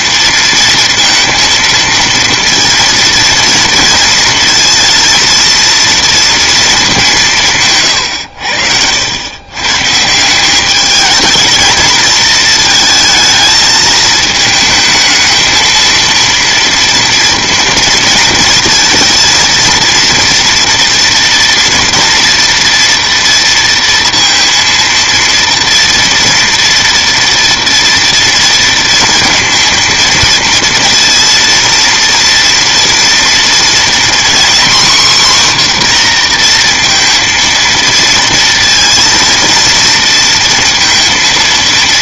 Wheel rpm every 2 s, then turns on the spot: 230, 230, 230, 220, 80, 190, 220, 220, 230, 230, 230, 230, 230, 230, 230, 230, 230, 250, 240, 230, 230.
none